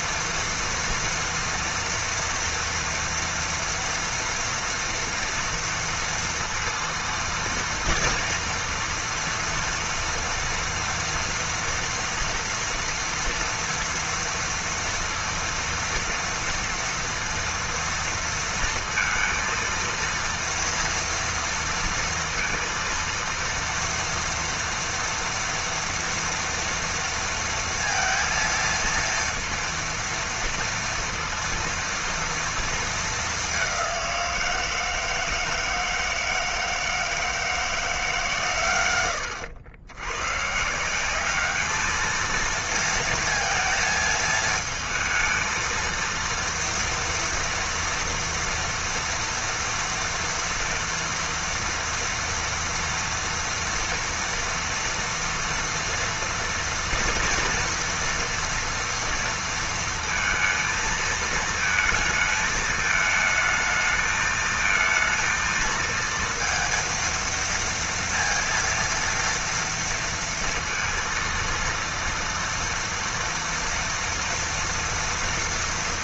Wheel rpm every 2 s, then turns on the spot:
230, 230, 230, 230, 230, 230, 230, 230, 230, 230, 230, 230, 230, 230, 230, 230, 220, 160, 160, 110, 180, 230, 220, 230, 230, 230, 230, 230, 240, 230, 220, 220, 230, 230, 230, 230, 230, 230.
none